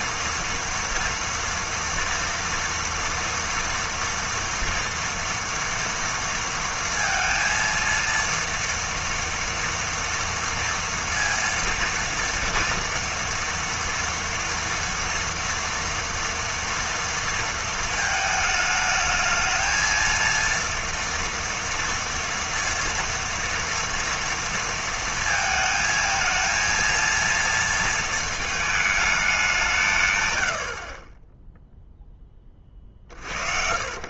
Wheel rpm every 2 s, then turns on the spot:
230, 230, 240, 230, 230, 230, 230, 230, 230, 220, 230, 230, 230, 230, 220, 50, 40.
none